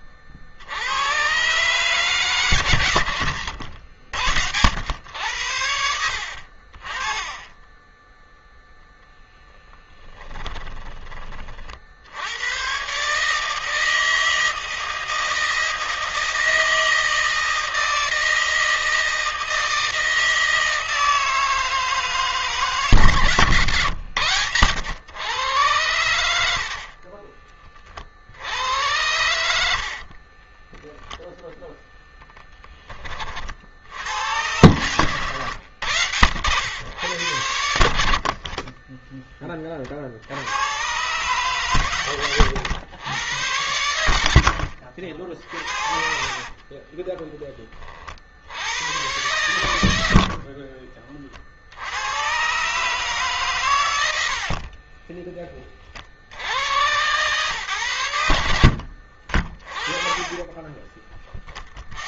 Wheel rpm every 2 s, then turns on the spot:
60, 140, 90, 90, 10, 20, 100, 160, 160, 160, 160, 150, 90, 90, 60, 20, 20, 100, 90, 30, 80, 100, 70, 30, 80, 60, 120, 60, 80, 90, 20.
10-12 30-32 44-48 50-52 54-56 60-62